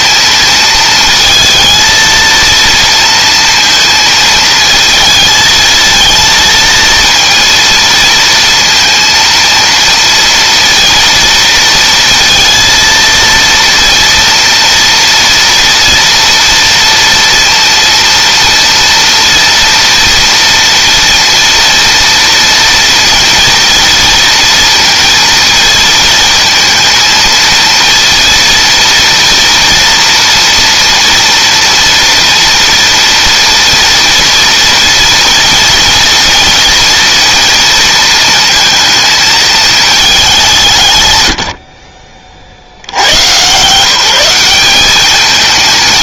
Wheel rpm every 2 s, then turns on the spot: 220, 230, 220, 230, 230, 230, 230, 240, 230, 230, 230, 230, 230, 230, 230, 230, 240, 230, 230, 220, 120, 100, 200.
none